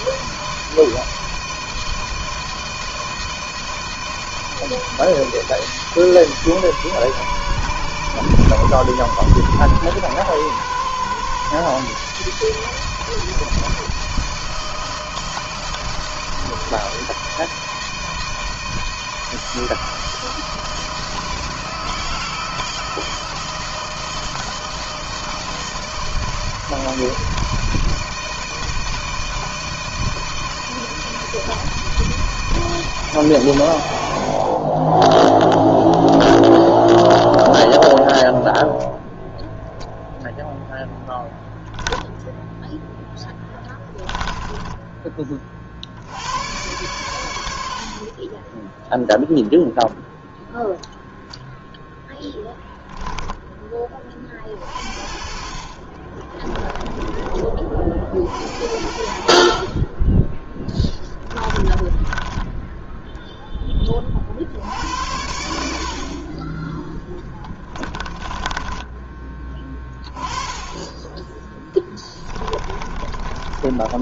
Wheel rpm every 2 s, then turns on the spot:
160, 160, 160, 150, 130, 130, 150, 160, 160, 160, 160, 160, 160, 160, 160, 160, 160, 40, 0, 0, 0, 0, 10, 100, 10, 0, 0, 40, 20, 70, 20, 10, 60, 20, 20, 20, 20.
44-46 56-58 60-62 68-70 72-74